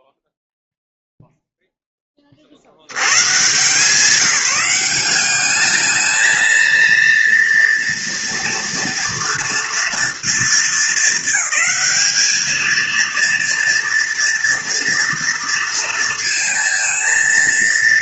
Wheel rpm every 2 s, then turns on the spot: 0, 70, 180, 230, 230, 210, 220, 230, 230.
none